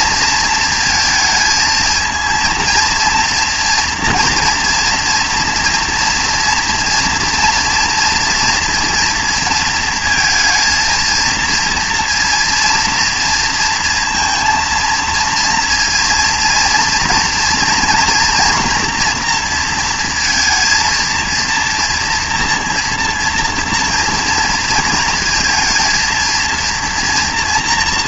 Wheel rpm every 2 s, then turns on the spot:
230, 230, 230, 230, 230, 230, 230, 230, 230, 240, 230, 230, 230, 230.
none